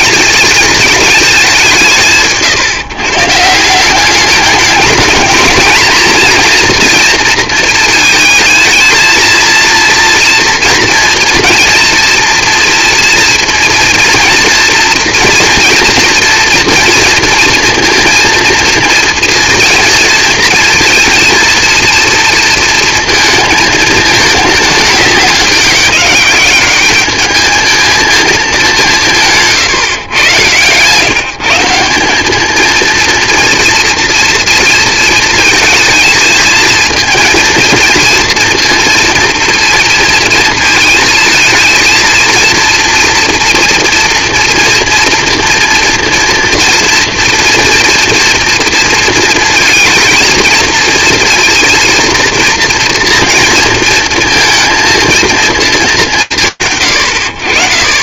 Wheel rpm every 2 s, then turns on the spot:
220, 160, 210, 240, 220, 240, 240, 230, 240, 230, 230, 230, 210, 200, 210, 130, 220, 230, 220, 230, 220, 230, 230, 230, 230, 230, 240, 230, 100.
30-32